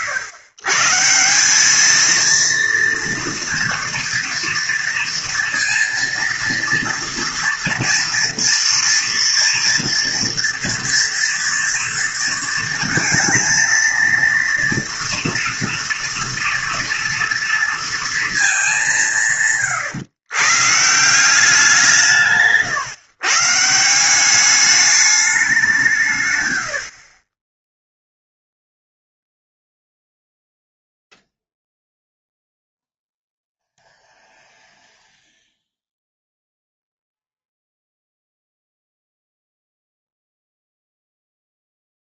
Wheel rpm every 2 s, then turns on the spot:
130, 230, 230, 230, 230, 230, 230, 230, 230, 210, 150, 130, 200, 90, 0, 0, 0, 0, 0, 0, 0.
none